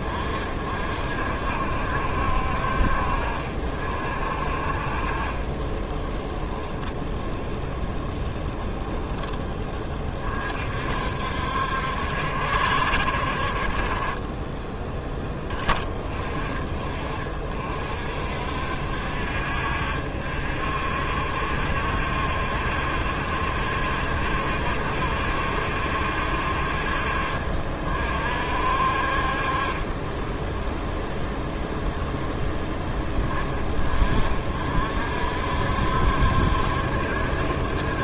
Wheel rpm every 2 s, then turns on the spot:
50, 50, 40, 10, 0, 50, 60, 20, 40, 60, 60, 70, 60, 60, 60, 0, 10, 50, 70.
4-6